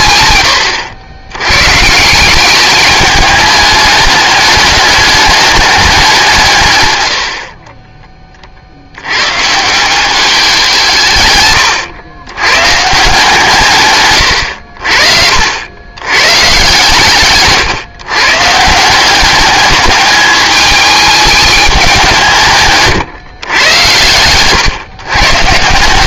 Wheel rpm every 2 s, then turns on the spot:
100, 200, 210, 140, 50, 180, 120, 70, 140, 150, 210, 150, 130.
none